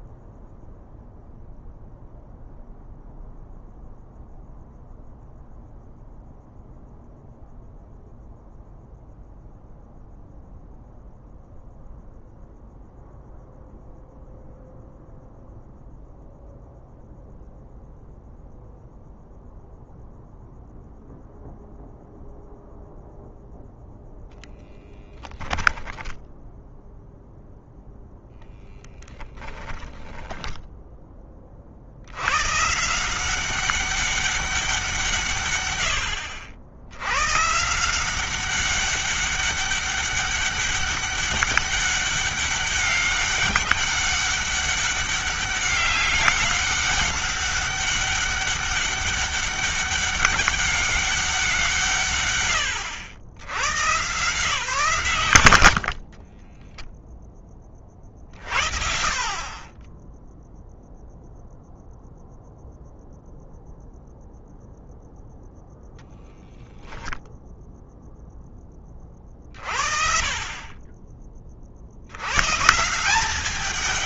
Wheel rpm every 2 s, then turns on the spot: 0, 0, 0, 0, 0, 0, 0, 0, 0, 0, 0, 0, 10, 0, 10, 10, 140, 170, 80, 190, 200, 200, 200, 200, 200, 200, 100, 140, 10, 30, 0, 0, 0, 0, 20, 30, 150.
24-26 56-58